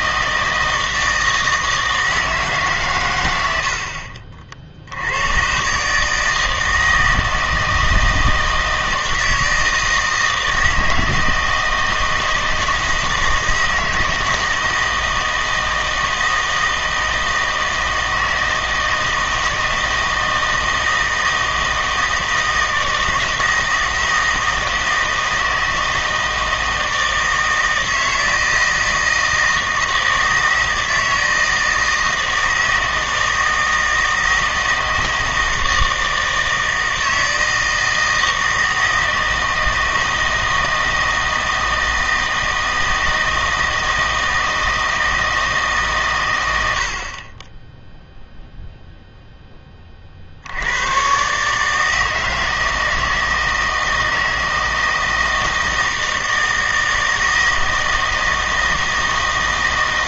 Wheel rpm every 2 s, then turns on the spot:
160, 140, 70, 160, 160, 160, 160, 160, 160, 160, 160, 160, 160, 160, 160, 160, 160, 160, 160, 160, 160, 160, 160, 80, 0, 90, 160, 160, 160, 160.
none